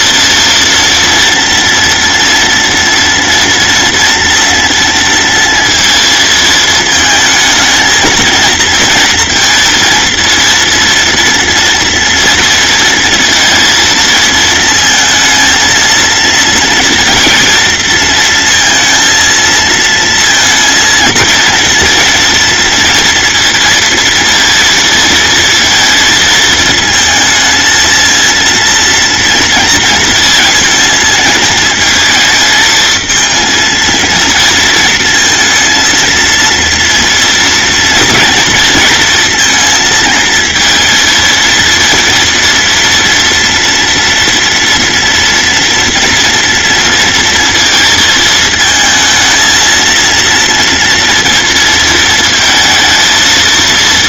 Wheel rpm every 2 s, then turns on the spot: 230, 230, 230, 220, 230, 230, 220, 220, 230, 230, 230, 230, 230, 220, 230, 230, 220, 230, 230, 230, 230, 230, 230, 230, 220, 230, 230.
none